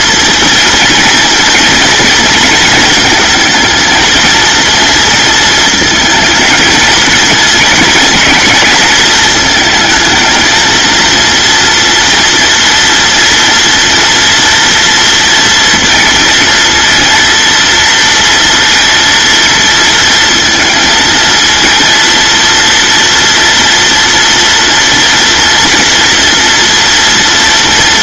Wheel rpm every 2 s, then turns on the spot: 230, 220, 230, 230, 220, 230, 230, 230, 230, 230, 220, 230, 230, 230.
none